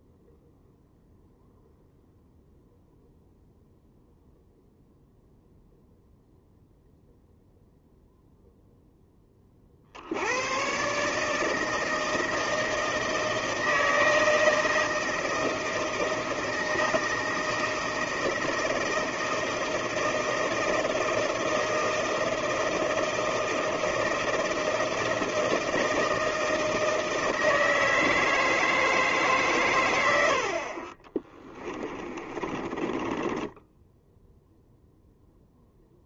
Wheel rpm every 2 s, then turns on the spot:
0, 0, 0, 0, 10, 140, 160, 160, 160, 160, 160, 160, 160, 160, 150, 30, 20, 0.
30-34